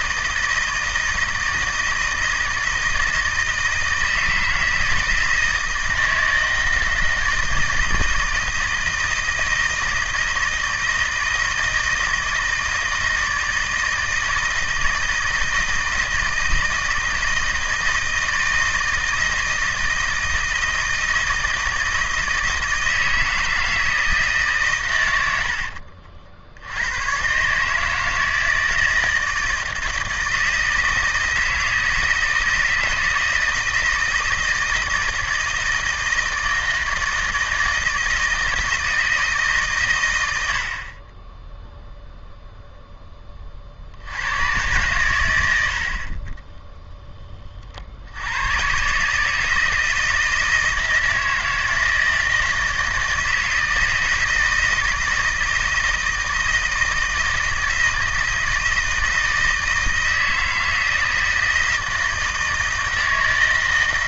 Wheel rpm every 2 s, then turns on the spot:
160, 160, 160, 160, 160, 160, 160, 160, 160, 160, 160, 160, 120, 100, 160, 160, 170, 160, 160, 160, 40, 0, 110, 10, 130, 160, 160, 160, 160, 160, 160, 160.
40-42